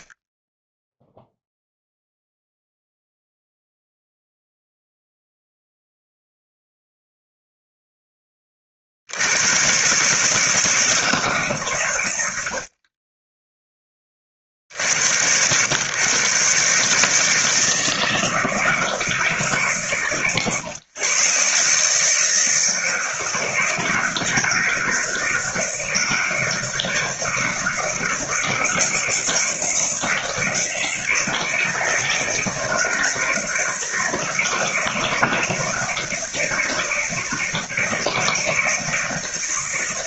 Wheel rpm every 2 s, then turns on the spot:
0, 0, 0, 0, 60, 150, 30, 80, 150, 160, 120, 160, 170, 160, 160, 160, 160, 160, 160, 160.
none